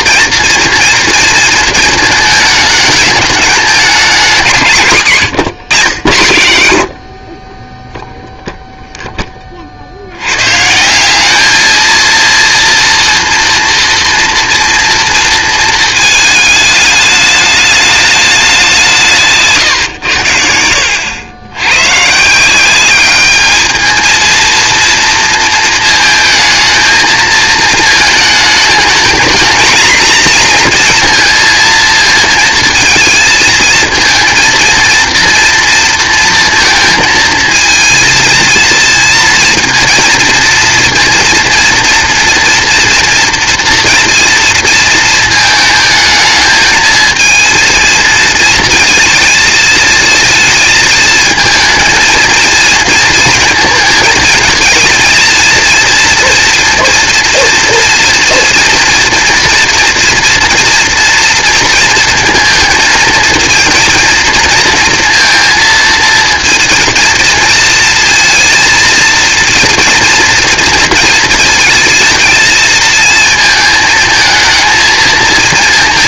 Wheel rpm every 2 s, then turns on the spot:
240, 220, 150, 70, 0, 160, 230, 240, 210, 190, 90, 190, 230, 220, 220, 240, 220, 230, 230, 220, 230, 240, 230, 220, 230, 220, 230, 220, 230, 230, 240, 230, 230, 230, 230, 230, 220, 220.
none